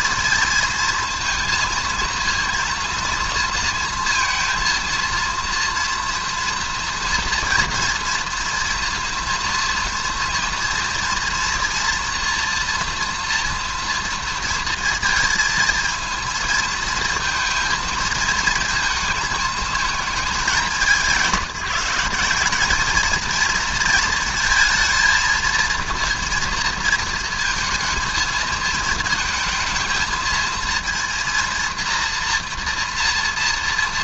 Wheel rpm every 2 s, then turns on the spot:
230, 230, 230, 230, 240, 230, 240, 230, 230, 220, 200, 200, 230, 230, 220, 230, 230.
none